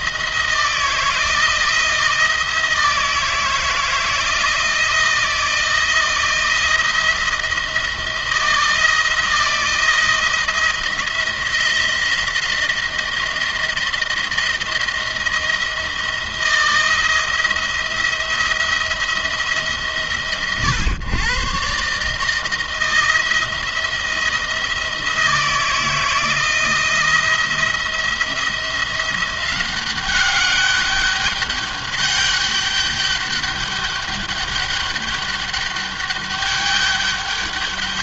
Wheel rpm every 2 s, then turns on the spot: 160, 160, 160, 170, 170, 170, 170, 170, 170, 170, 130, 160, 170, 160, 170, 200, 200, 200, 200.
none